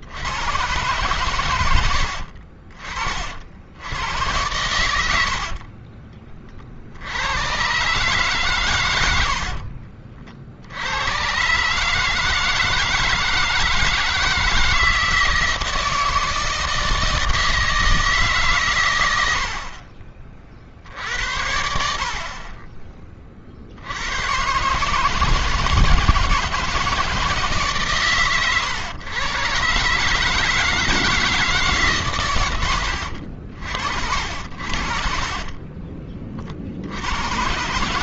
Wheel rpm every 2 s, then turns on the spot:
90, 40, 90, 40, 120, 60, 160, 160, 160, 140, 50, 40, 130, 160, 130, 150, 120, 60, 50.
none